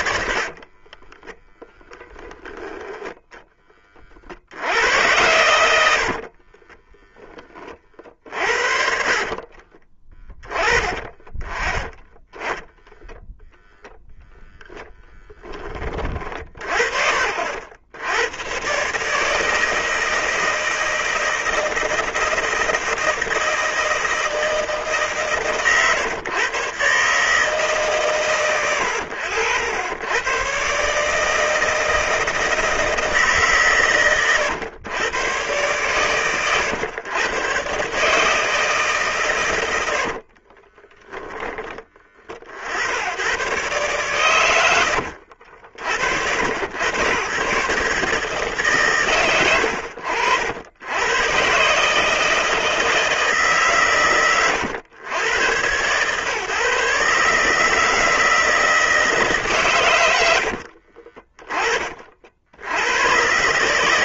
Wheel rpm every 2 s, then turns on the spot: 20, 10, 80, 20, 50, 20, 10, 10, 50, 140, 160, 160, 150, 140, 90, 150, 160, 110, 120, 150, 10, 80, 80, 110, 120, 100, 160, 100, 150, 150, 30, 90.
0-2 6-14 40-42